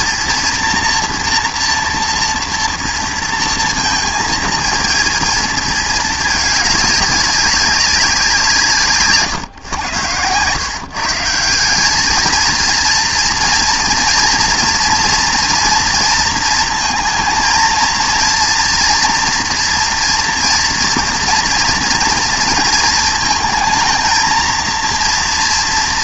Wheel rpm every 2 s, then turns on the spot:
230, 230, 230, 210, 160, 120, 220, 230, 230, 230, 230, 230, 230.
none